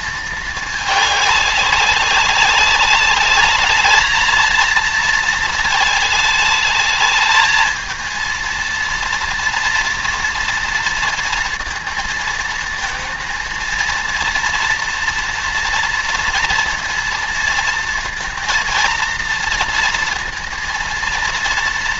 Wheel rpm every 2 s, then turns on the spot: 210, 200, 230, 220, 230, 230, 230, 230, 230, 230, 230.
none